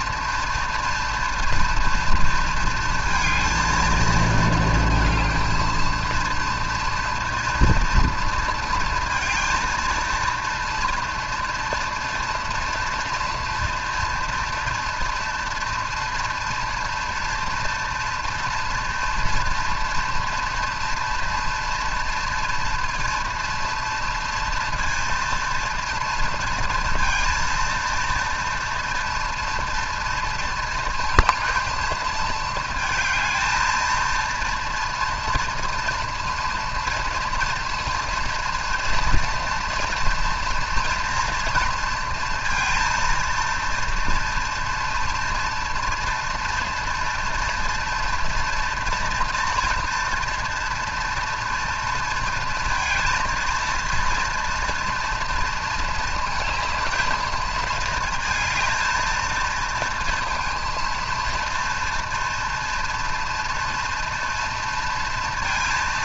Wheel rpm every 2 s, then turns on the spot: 230, 230, 230, 230, 230, 230, 230, 230, 230, 230, 230, 230, 230, 230, 230, 230, 220, 230, 230, 230, 230, 230, 230, 230, 230, 240, 220, 230, 220, 220, 230, 230, 230.
none